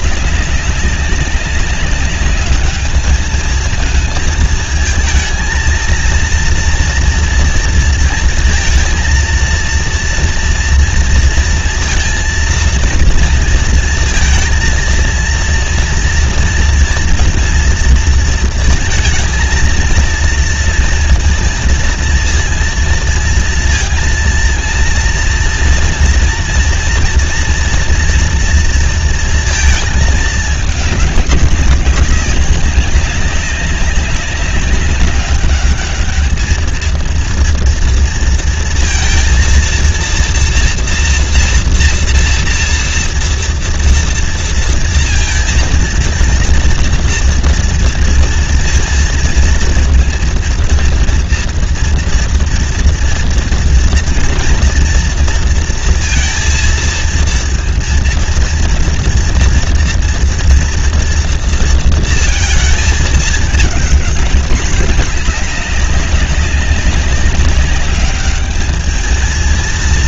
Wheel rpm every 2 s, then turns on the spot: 190, 200, 220, 230, 230, 230, 230, 230, 230, 230, 230, 230, 230, 230, 230, 210, 200, 200, 220, 230, 240, 230, 230, 230, 230, 230, 230, 230, 230, 230, 230, 230, 210, 200, 210.
none